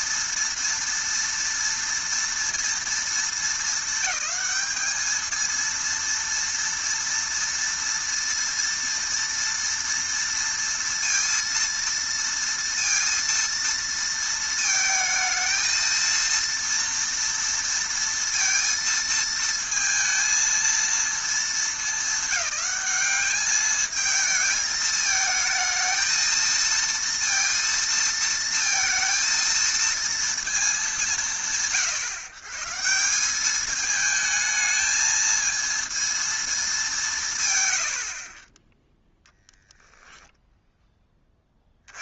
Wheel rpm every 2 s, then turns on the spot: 230, 230, 210, 230, 230, 230, 230, 220, 230, 230, 230, 200, 220, 230, 230, 190, 150, 220, 210, 10, 10.
none